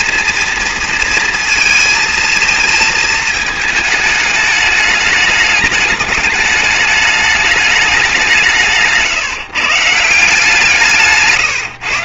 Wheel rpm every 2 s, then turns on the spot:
230, 220, 210, 210, 180, 170.
none